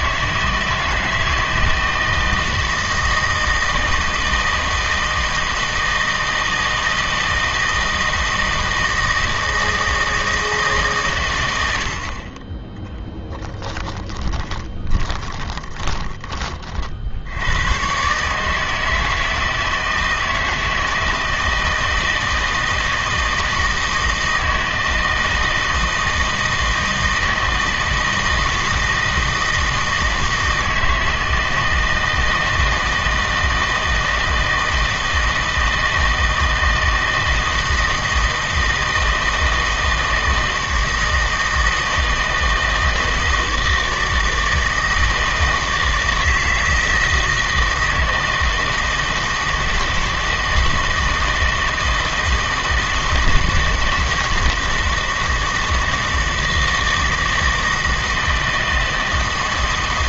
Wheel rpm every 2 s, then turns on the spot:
160, 160, 160, 160, 160, 150, 10, 30, 30, 160, 160, 160, 160, 160, 160, 160, 160, 160, 160, 160, 160, 160, 160, 160, 160, 160, 160, 160, 170, 160.
14-16